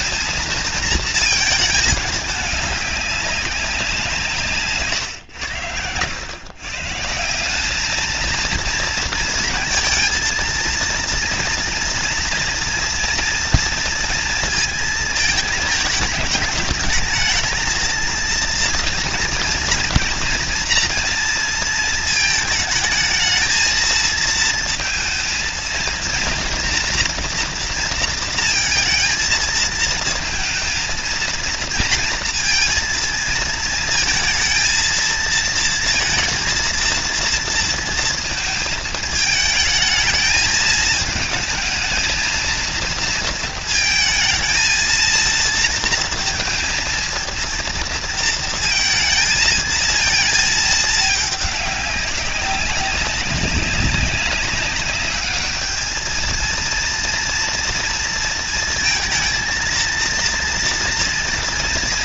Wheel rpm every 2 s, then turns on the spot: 230, 200, 120, 160, 230, 230, 230, 220, 220, 230, 230, 220, 230, 230, 230, 230, 230, 230, 230, 220, 220, 230, 230, 230, 230, 210, 200, 210, 230, 230, 230.
none